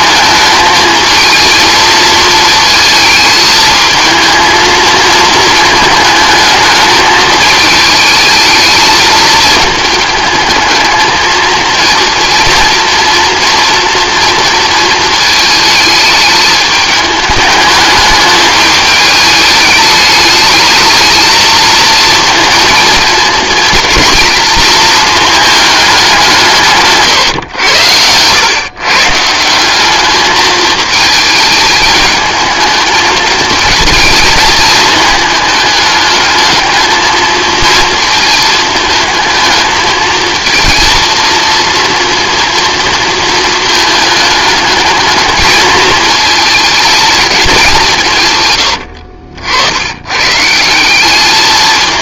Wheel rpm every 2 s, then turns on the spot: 220, 220, 230, 220, 220, 220, 230, 230, 210, 210, 220, 230, 220, 150, 130, 220, 220, 220, 220, 220, 230, 230, 210, 220, 120, 170.
none